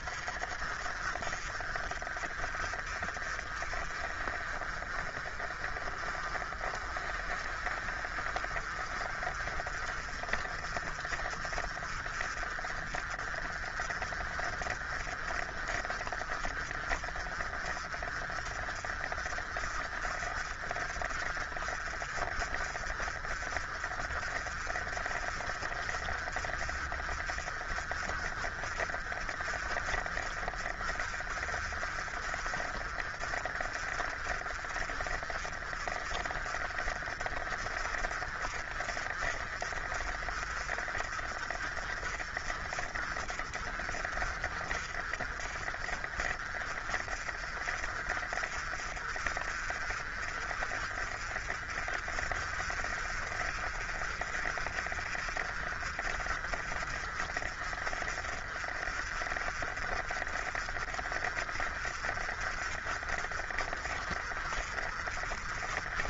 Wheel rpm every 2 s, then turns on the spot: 40, 40, 40, 40, 40, 40, 40, 40, 40, 40, 40, 40, 40, 40, 40, 40, 40, 40, 40, 40, 40, 40, 40, 40, 40, 40, 40, 40, 40, 40, 40, 40, 40.
none